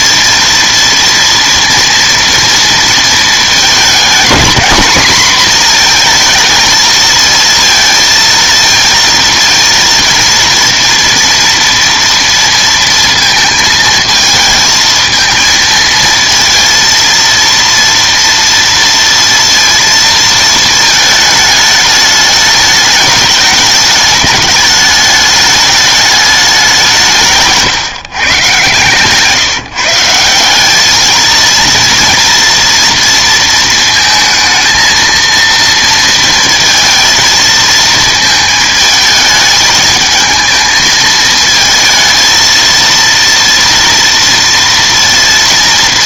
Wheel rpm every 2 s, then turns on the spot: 230, 230, 230, 230, 230, 240, 230, 220, 230, 230, 220, 210, 210, 190, 140, 190, 230, 220, 230, 220, 220, 230, 230.
none